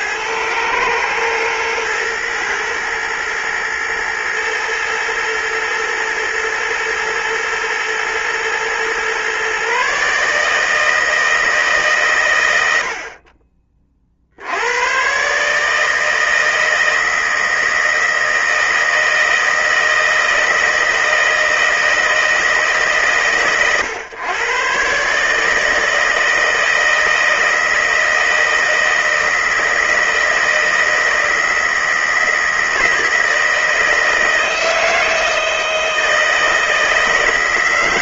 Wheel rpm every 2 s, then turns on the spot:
110, 120, 110, 110, 120, 150, 90, 80, 160, 160, 160, 150, 120, 160, 160, 160, 160, 160, 160.
none